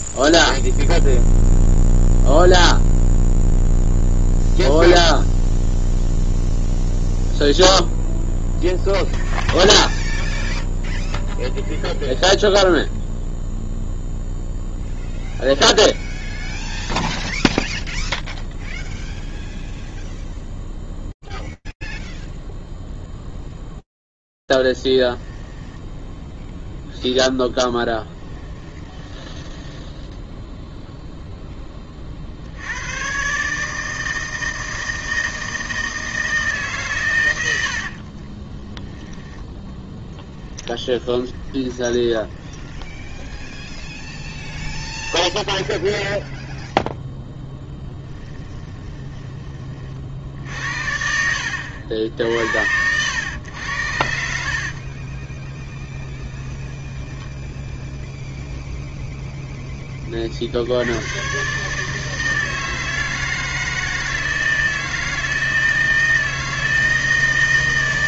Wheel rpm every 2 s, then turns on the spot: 0, 0, 0, 0, 0, 0, 0, 0, 0, 0, 0, 0, 0, 10, 10, 10, 60, 160, 150, 20, 20, 20, 10, 0, 40, 70, 80, 10, 0, 80, 160, 160, 160, 160.
30-32 38-46 54-56